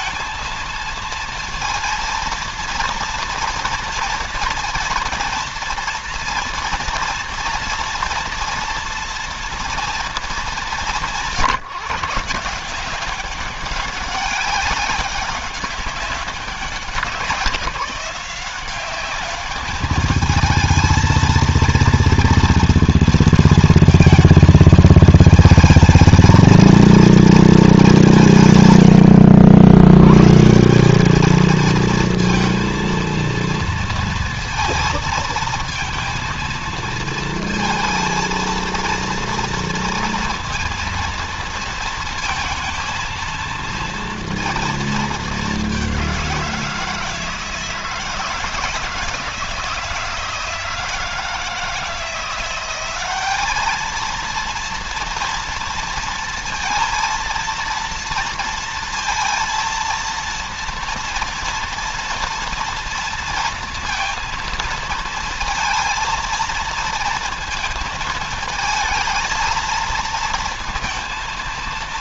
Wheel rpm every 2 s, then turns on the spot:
230, 230, 230, 230, 230, 180, 180, 200, 190, 200, 230, 230, 220, 230, 100, 200, 230, 230, 230, 230, 230, 230, 220, 160, 160, 160, 190, 230, 230, 230, 230, 230, 220, 230, 220, 230.
none